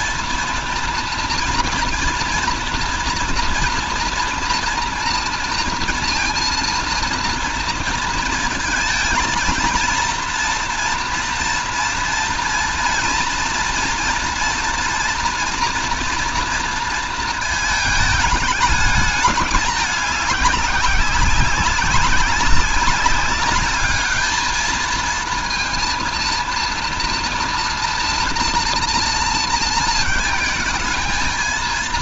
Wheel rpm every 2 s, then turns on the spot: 230, 230, 230, 230, 230, 230, 230, 230, 230, 210, 200, 190, 210, 230, 230, 220.
none